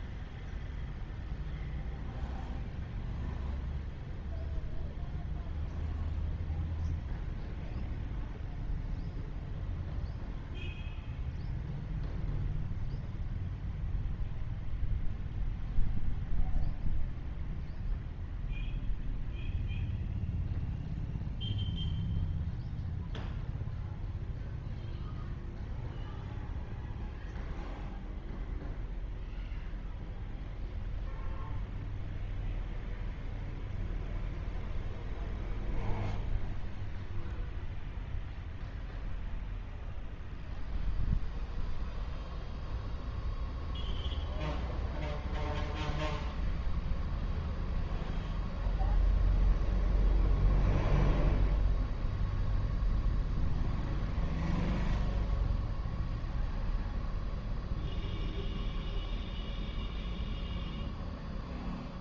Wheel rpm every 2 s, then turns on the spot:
0, 0, 0, 0, 0, 0, 0, 0, 0, 0, 0, 0, 0, 0, 0, 0, 0, 0, 0, 0, 0, 0, 0, 0, 0, 0, 0, 0, 0, 0, 0.
none